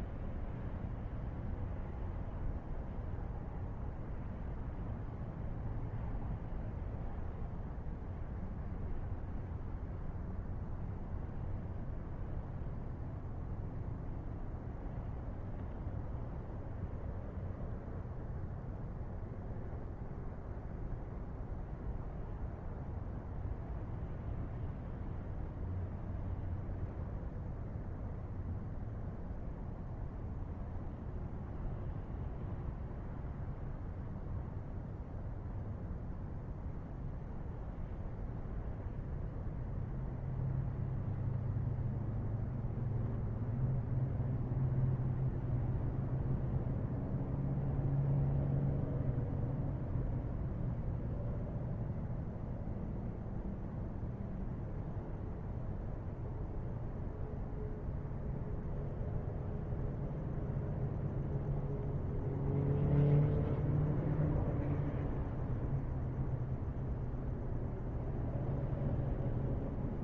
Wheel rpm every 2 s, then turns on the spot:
0, 0, 0, 0, 0, 0, 0, 0, 0, 0, 0, 0, 0, 0, 0, 0, 0, 0, 0, 0, 0, 0, 0, 0, 0, 0, 0, 0, 0, 0, 0, 0, 0, 0, 0.
none